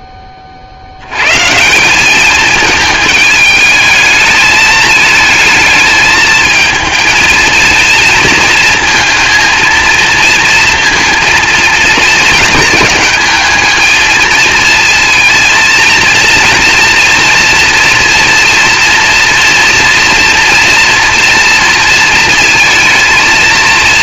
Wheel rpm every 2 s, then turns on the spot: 60, 220, 220, 220, 220, 230, 210, 220, 230, 230, 240, 230.
none